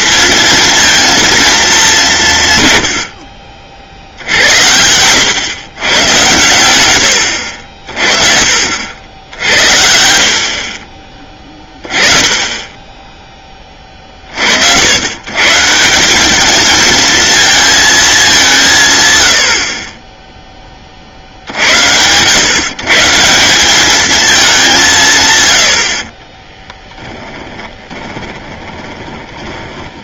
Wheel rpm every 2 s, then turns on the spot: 230, 120, 80, 100, 70, 30, 10, 80, 220, 140, 30, 140, 180, 10, 30.
26-30